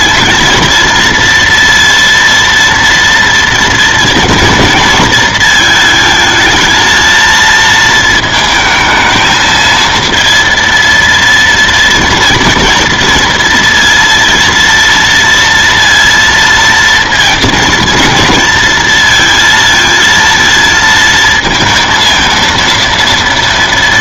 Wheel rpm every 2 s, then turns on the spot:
230, 230, 230, 230, 220, 230, 240, 230, 230, 230, 230, 230.
none